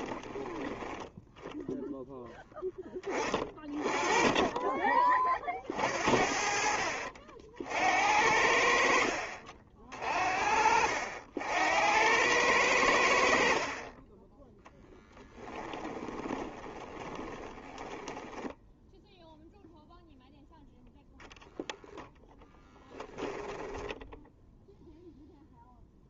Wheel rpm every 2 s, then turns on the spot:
10, 10, 20, 50, 60, 60, 90, 0, 20, 0, 0, 10, 0.
16-18 22-24